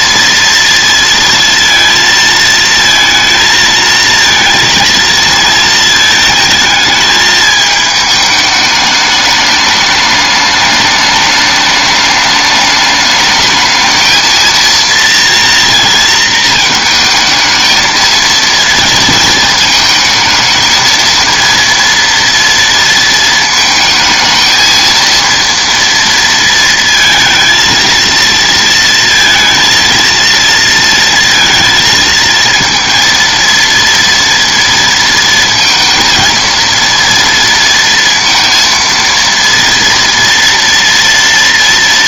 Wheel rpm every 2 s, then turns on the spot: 230, 230, 230, 220, 210, 210, 210, 230, 220, 230, 220, 230, 230, 230, 230, 230, 230, 230, 230, 230, 230.
none